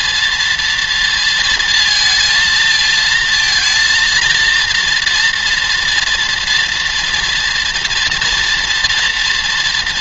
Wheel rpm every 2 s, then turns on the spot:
230, 220, 230, 230, 230.
none